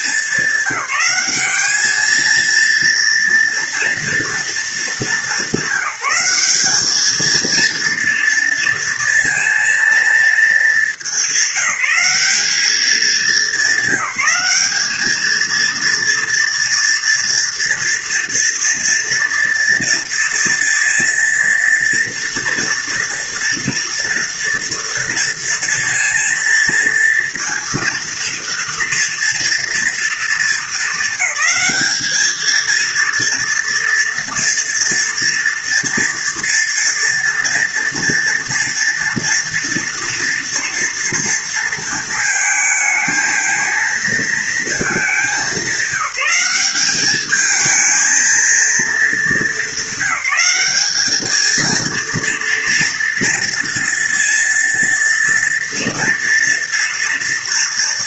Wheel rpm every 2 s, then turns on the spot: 210, 220, 230, 200, 230, 230, 210, 190, 230, 230, 230, 230, 230, 230, 230, 230, 220, 240, 230, 230, 230, 220, 220, 190, 230, 200, 230, 230, 230.
none